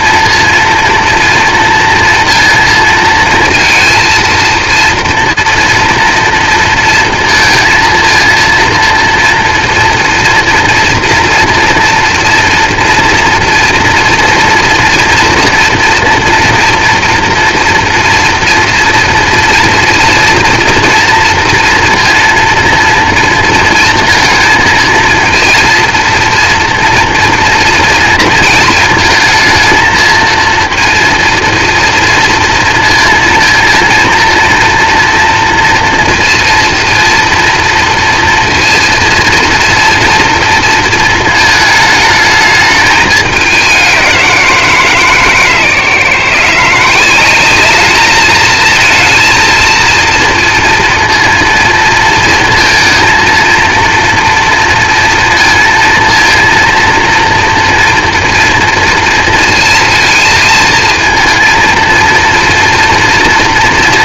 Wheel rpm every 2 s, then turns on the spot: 230, 230, 230, 230, 230, 230, 230, 230, 230, 240, 240, 230, 230, 230, 230, 220, 230, 230, 230, 230, 230, 220, 190, 150, 210, 230, 230, 240, 230, 230, 230, 230.
none